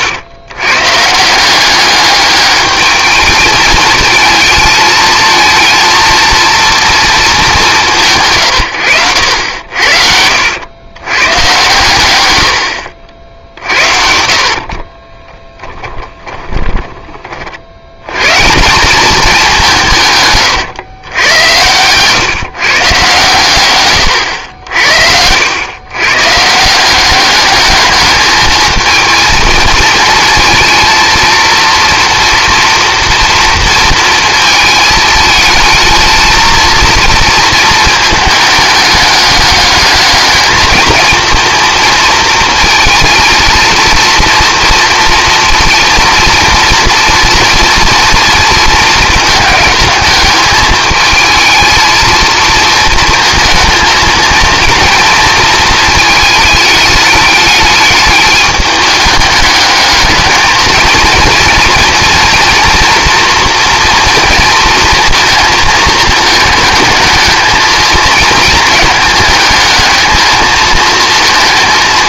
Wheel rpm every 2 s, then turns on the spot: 130, 210, 220, 230, 120, 70, 80, 40, 20, 170, 120, 140, 80, 160, 220, 230, 230, 220, 230, 210, 220, 220, 230, 230, 220, 220, 230, 230, 210, 210, 220, 240, 230, 210, 220, 220.
16-18